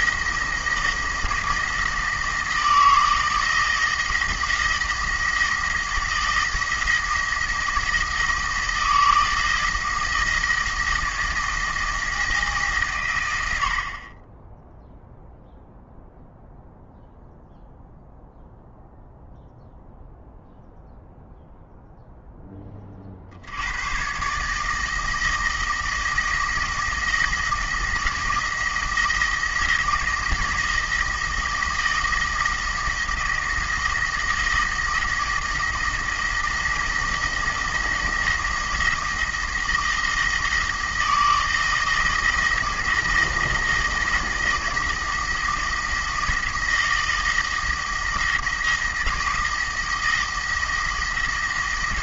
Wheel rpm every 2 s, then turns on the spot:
170, 160, 160, 170, 160, 160, 140, 10, 0, 0, 0, 30, 160, 160, 170, 160, 170, 170, 170, 170, 160, 170, 170, 160, 160, 160.
none